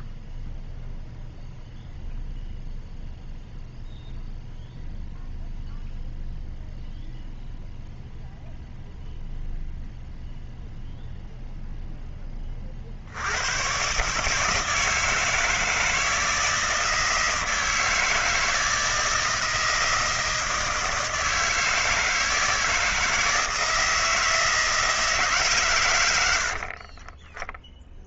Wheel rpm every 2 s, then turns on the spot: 0, 0, 0, 0, 0, 0, 20, 150, 160, 160, 160, 160, 160, 70.
none